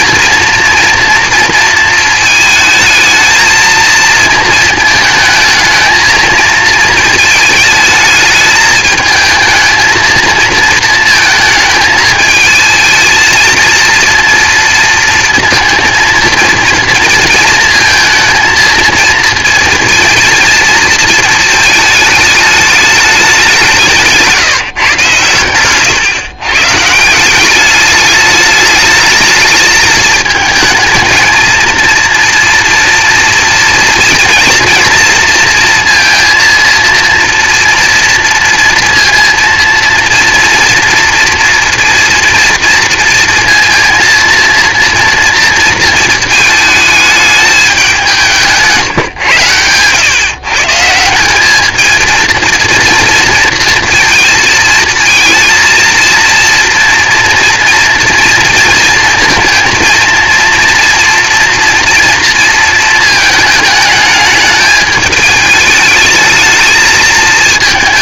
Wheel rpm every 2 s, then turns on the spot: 230, 220, 220, 220, 220, 220, 220, 230, 230, 230, 230, 210, 150, 140, 210, 220, 230, 230, 230, 230, 230, 230, 230, 220, 150, 150, 230, 230, 230, 230, 230, 230, 210, 220.
none